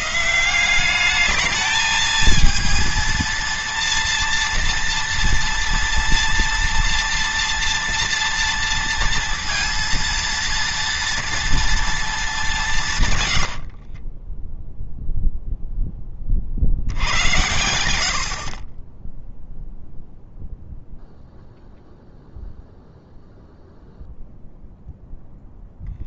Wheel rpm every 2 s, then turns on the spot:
200, 230, 230, 230, 230, 230, 160, 0, 100, 30, 0, 0, 0.
none